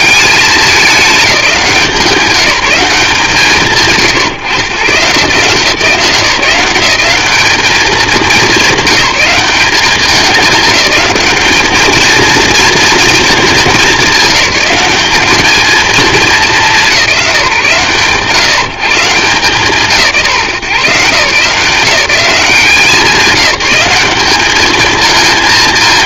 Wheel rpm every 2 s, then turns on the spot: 210, 170, 130, 190, 200, 210, 230, 200, 200, 140, 130, 180, 220.
none